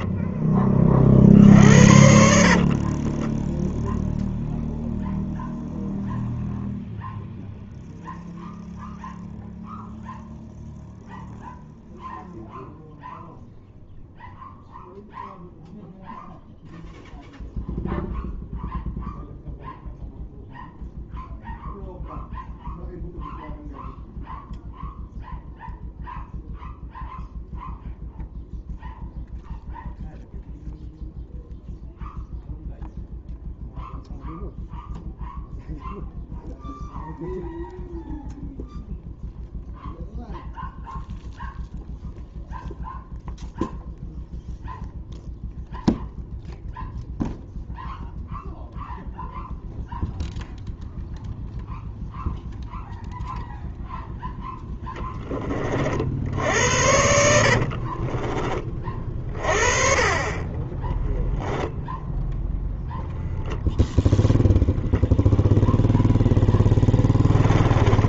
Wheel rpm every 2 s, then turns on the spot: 40, 30, 0, 0, 0, 0, 0, 0, 0, 0, 0, 0, 0, 0, 0, 0, 0, 0, 0, 0, 0, 0, 0, 0, 0, 0, 0, 10, 80, 30, 10, 0, 0, 10.
2-4 66-68